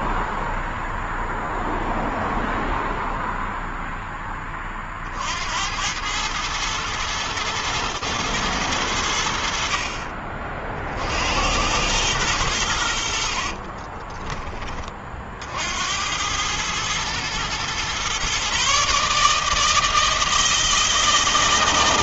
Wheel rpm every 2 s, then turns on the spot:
0, 0, 10, 100, 110, 40, 100, 30, 100, 130, 160.
14-16